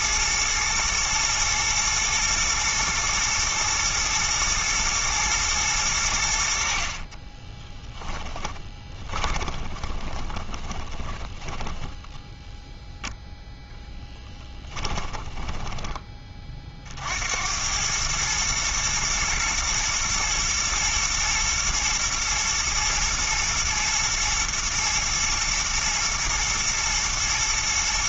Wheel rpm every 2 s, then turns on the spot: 110, 120, 120, 50, 20, 20, 0, 10, 50, 110, 120, 110, 110, 120.
8-12 14-16